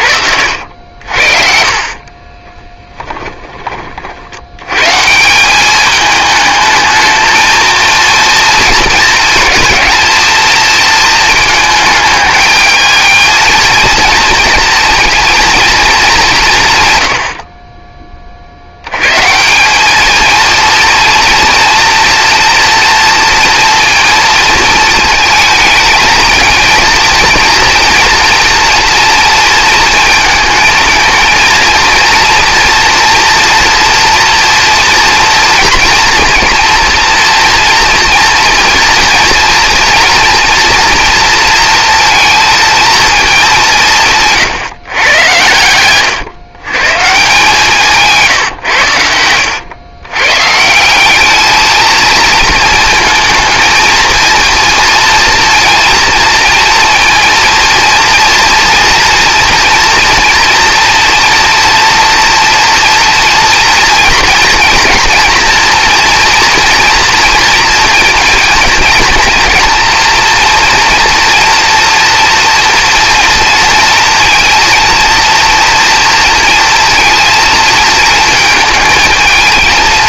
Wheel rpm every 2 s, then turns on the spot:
70, 20, 100, 220, 220, 220, 220, 230, 150, 70, 230, 230, 230, 230, 240, 230, 240, 230, 230, 230, 230, 230, 140, 120, 120, 150, 230, 230, 230, 230, 230, 240, 220, 230, 230, 230, 230, 230, 230, 220.
2-4